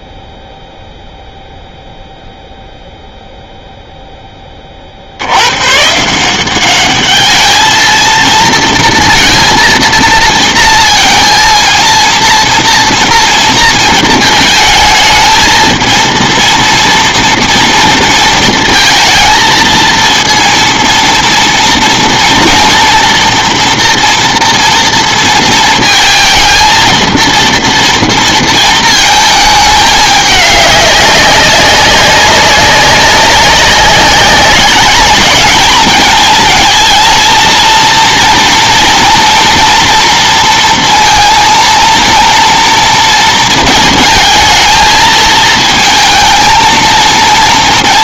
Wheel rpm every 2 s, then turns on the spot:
0, 0, 30, 190, 230, 230, 230, 220, 230, 230, 230, 230, 230, 220, 230, 200, 190, 200, 230, 240, 230, 230, 220, 230.
none